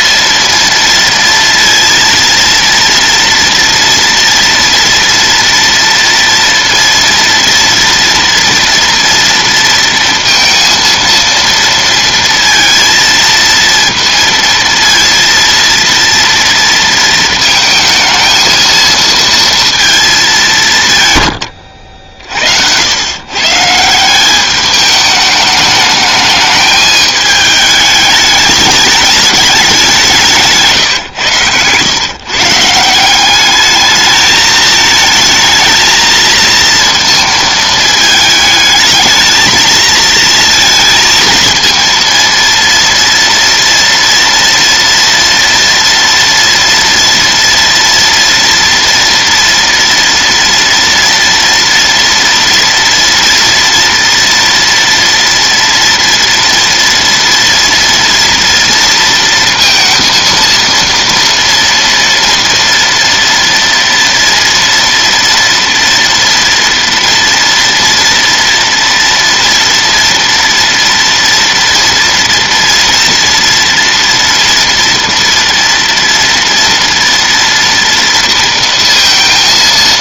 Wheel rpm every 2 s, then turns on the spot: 230, 230, 240, 230, 230, 230, 230, 230, 230, 230, 140, 100, 210, 210, 210, 140, 170, 220, 230, 220, 220, 230, 230, 230, 230, 230, 240, 230, 230, 230, 230, 230, 230, 240, 230, 230, 230, 230, 230, 230.
none